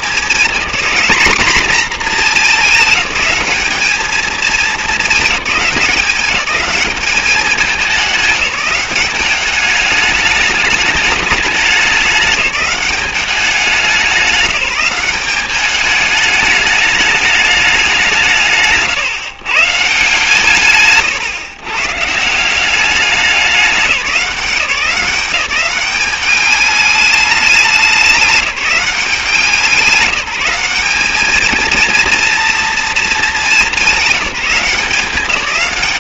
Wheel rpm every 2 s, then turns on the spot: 210, 220, 220, 200, 200, 210, 200, 190, 210, 160, 150, 180, 180, 200, 190, 190, 240, 180.
none